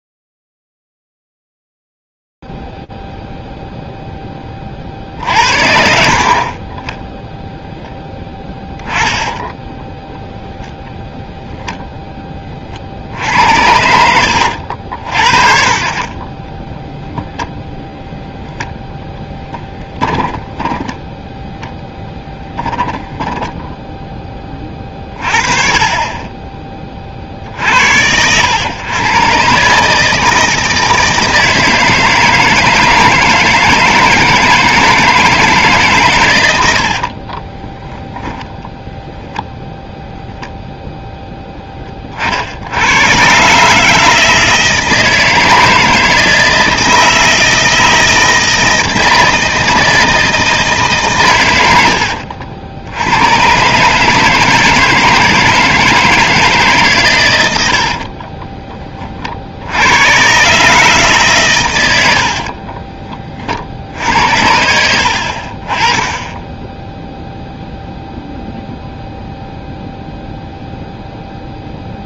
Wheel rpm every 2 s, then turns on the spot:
0, 0, 0, 60, 0, 0, 20, 80, 20, 0, 10, 10, 30, 30, 110, 160, 160, 160, 80, 0, 0, 80, 160, 160, 160, 160, 80, 160, 150, 30, 150, 40, 70, 10, 0, 0.
20-22 62-64